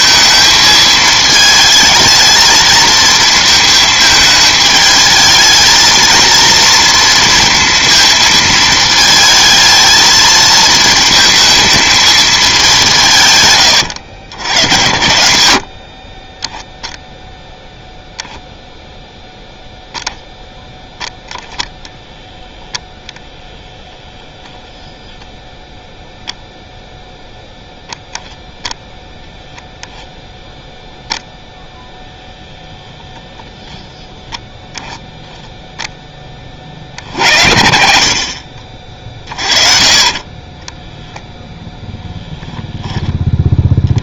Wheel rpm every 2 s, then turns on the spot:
220, 220, 220, 230, 220, 220, 200, 80, 10, 0, 10, 0, 0, 0, 0, 0, 0, 0, 40, 50, 10, 0.
40-42